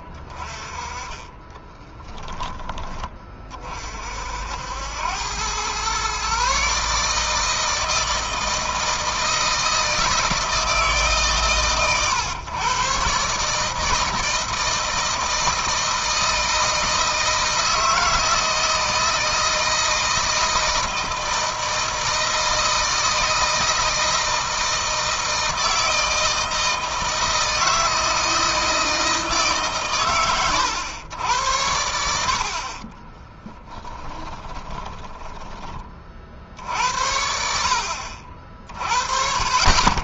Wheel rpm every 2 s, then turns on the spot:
30, 20, 80, 140, 160, 160, 120, 160, 160, 160, 160, 160, 160, 160, 160, 110, 40, 20, 60, 40.
32-36